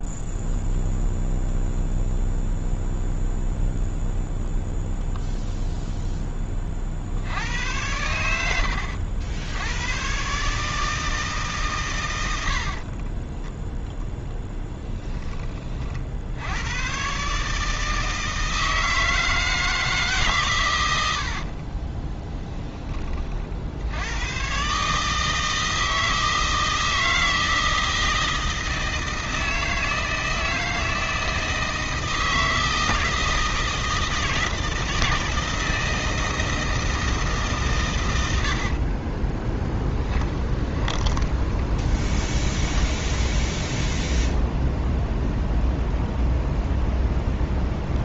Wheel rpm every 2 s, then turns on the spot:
0, 0, 0, 20, 80, 140, 80, 10, 90, 160, 130, 10, 120, 160, 160, 160, 160, 160, 160, 70, 20, 10, 0, 0.
12-14 40-44